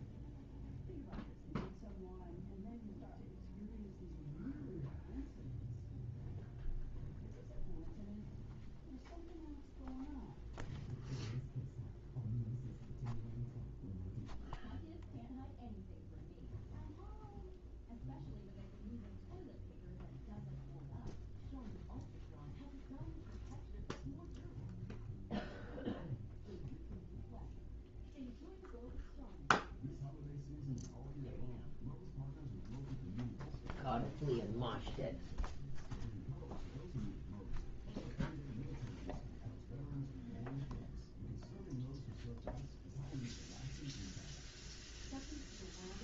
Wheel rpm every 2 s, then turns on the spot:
0, 0, 0, 0, 0, 0, 0, 0, 0, 0, 0, 0, 0, 0, 0, 0, 0, 0, 0, 0, 0, 0, 0.
none